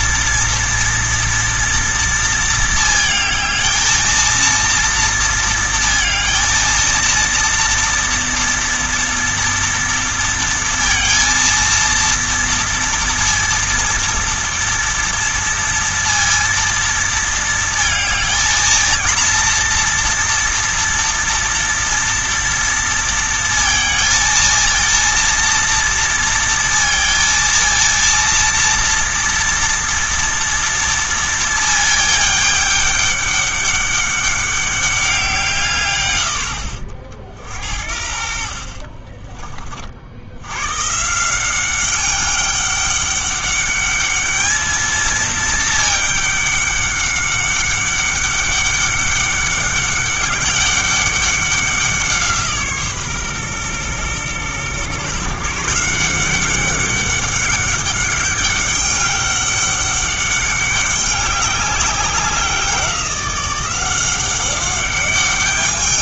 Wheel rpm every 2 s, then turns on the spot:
230, 220, 230, 230, 230, 230, 230, 230, 230, 220, 230, 230, 230, 230, 230, 240, 210, 200, 60, 50, 120, 200, 220, 200, 200, 200, 150, 120, 190, 200, 200, 180, 200.
38-40